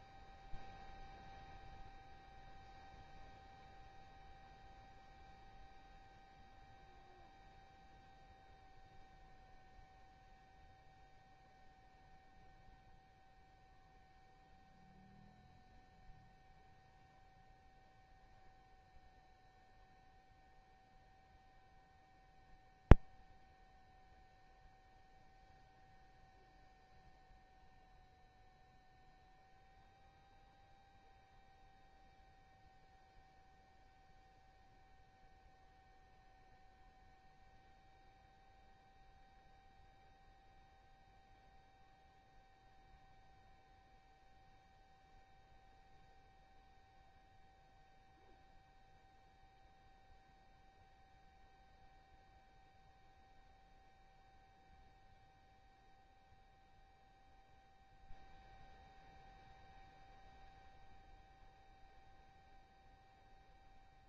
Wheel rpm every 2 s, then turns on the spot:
0, 0, 0, 0, 0, 0, 0, 0, 0, 0, 0, 0, 0, 0, 0, 0, 0, 0, 0, 0, 0, 0, 0, 0, 0, 0, 0, 0, 0, 0, 0, 0.
none